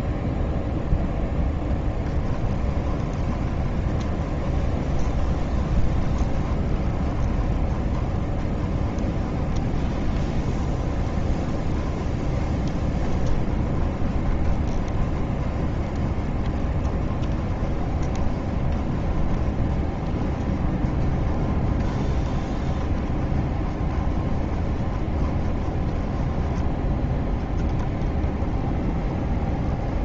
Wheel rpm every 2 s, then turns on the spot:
0, 10, 10, 10, 10, 20, 10, 20, 20, 10, 10, 10, 10, 10, 10.
none